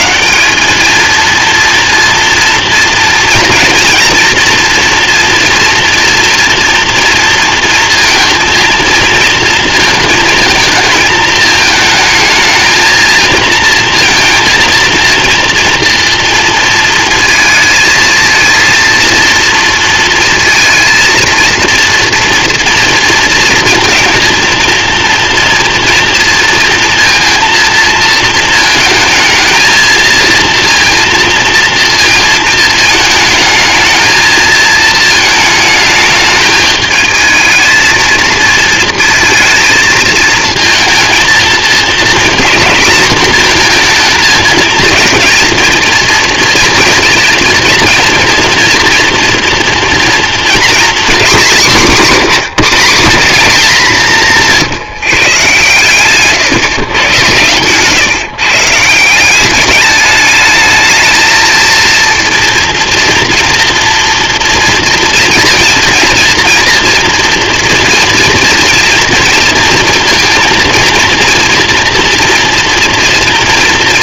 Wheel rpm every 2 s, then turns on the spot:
150, 230, 230, 240, 230, 230, 220, 230, 230, 230, 230, 230, 230, 230, 230, 220, 230, 220, 210, 220, 220, 230, 220, 230, 240, 230, 190, 180, 130, 140, 210, 230, 230, 240, 230, 230, 230.
52-54